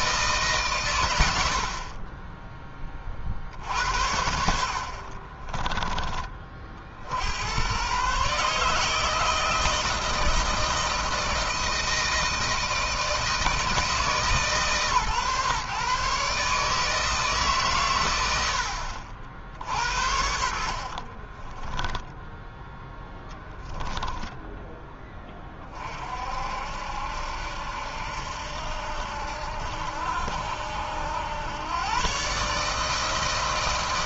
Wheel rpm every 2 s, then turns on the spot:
140, 20, 70, 40, 150, 160, 160, 140, 150, 70, 50, 10, 10, 60, 70, 80, 150.
4-6 20-22